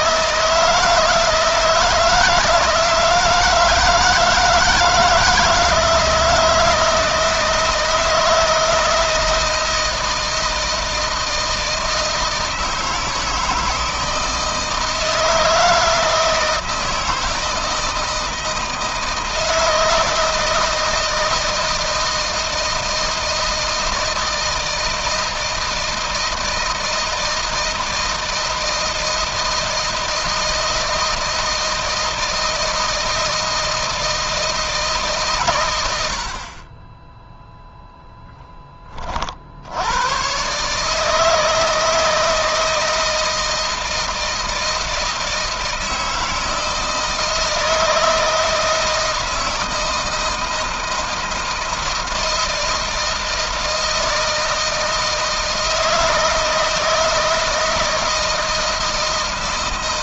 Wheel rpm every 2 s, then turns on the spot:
160, 160, 160, 160, 160, 160, 160, 160, 160, 160, 160, 160, 160, 160, 160, 160, 160, 160, 60, 10, 120, 160, 160, 160, 160, 160, 160, 160, 160, 160.
none